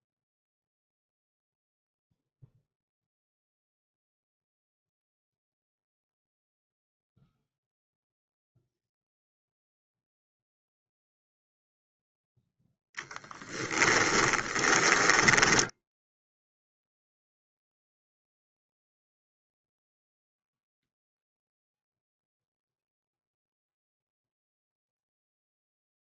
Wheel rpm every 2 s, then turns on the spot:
0, 0, 0, 0, 0, 0, 10, 10, 0, 0, 0, 0, 0.
14-16